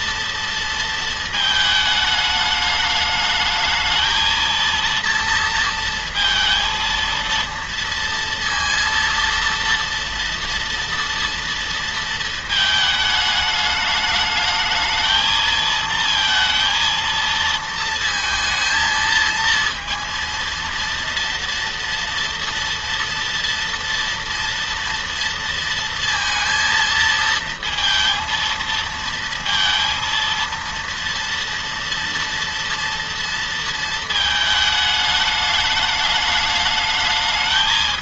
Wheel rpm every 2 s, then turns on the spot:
230, 210, 230, 230, 230, 230, 220, 220, 230, 220, 230, 230, 230, 230, 230, 230, 230, 220, 210.
none